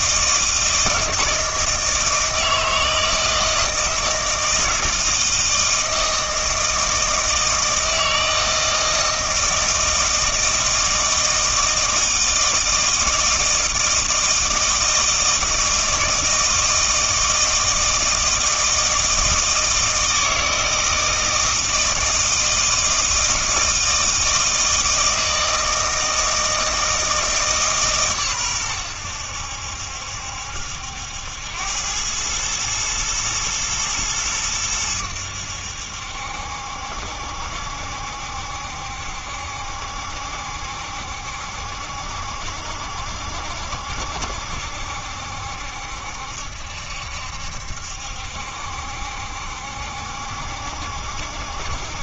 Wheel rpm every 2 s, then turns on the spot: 160, 160, 160, 160, 160, 160, 160, 160, 160, 160, 160, 160, 160, 160, 110, 70, 110, 100, 70, 70, 70, 70, 70, 70, 70, 70.
none